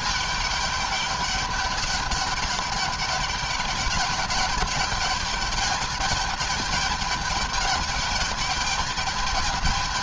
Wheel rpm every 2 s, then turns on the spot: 200, 200, 210, 210, 210.
none